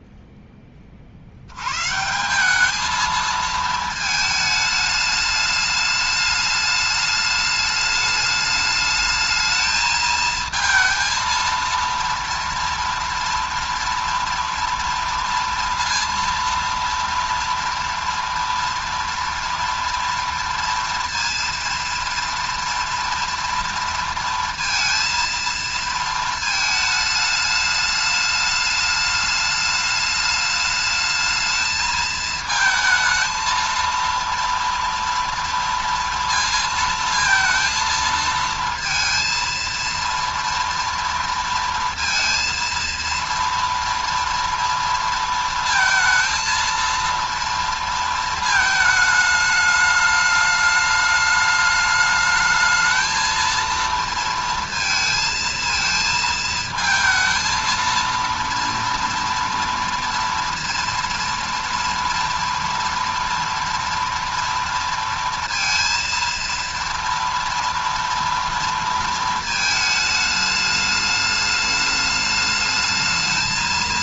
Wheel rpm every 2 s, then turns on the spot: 20, 200, 210, 210, 210, 230, 230, 230, 230, 230, 230, 230, 230, 220, 210, 210, 220, 230, 230, 230, 230, 230, 230, 230, 220, 210, 220, 230, 220, 230, 230, 240, 230, 230, 230, 210, 210.
none